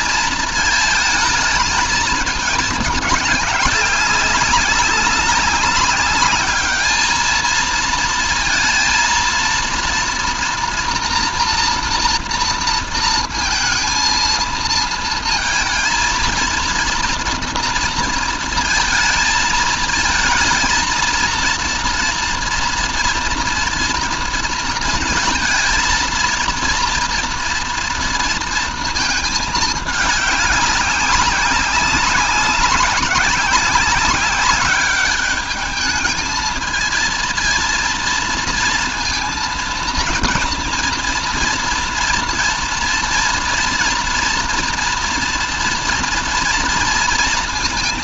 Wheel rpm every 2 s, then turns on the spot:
230, 220, 200, 210, 230, 230, 230, 220, 230, 230, 220, 230, 230, 230, 230, 200, 200, 200, 220, 230, 230, 230, 230, 230.
none